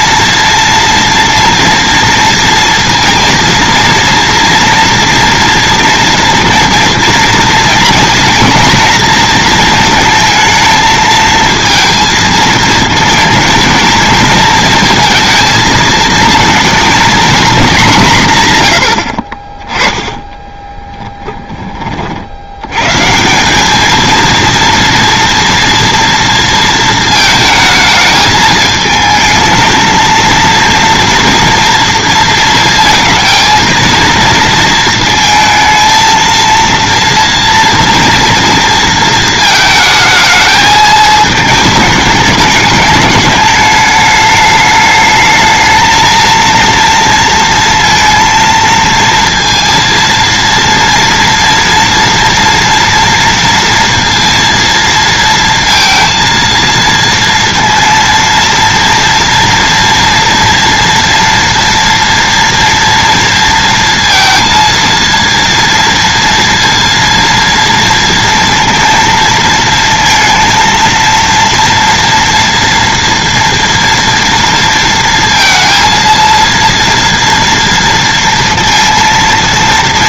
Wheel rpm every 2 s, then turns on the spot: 230, 230, 230, 240, 230, 220, 220, 220, 230, 140, 20, 100, 230, 230, 220, 230, 230, 230, 230, 230, 220, 210, 210, 230, 230, 230, 240, 230, 230, 230, 230, 230, 230, 230, 230, 230, 240, 230, 230, 230.
20-22